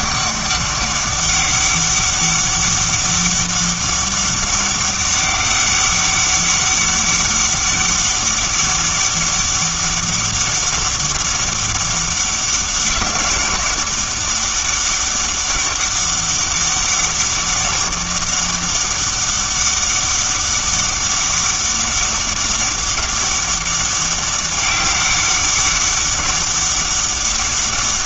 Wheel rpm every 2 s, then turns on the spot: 200, 200, 200, 200, 200, 200, 190, 200, 200, 200, 200, 200, 200, 200.
none